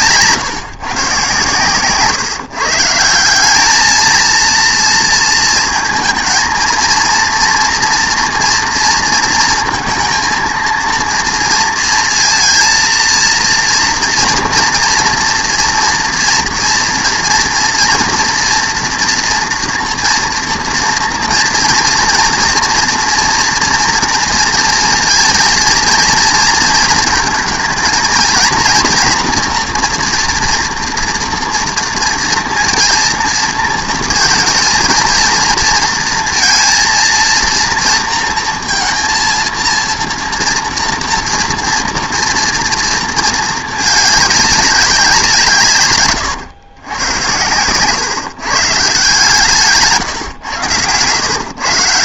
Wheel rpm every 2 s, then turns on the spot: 140, 150, 230, 230, 230, 230, 230, 240, 230, 230, 230, 240, 230, 230, 240, 230, 230, 230, 230, 230, 230, 230, 200, 100, 140, 110.
none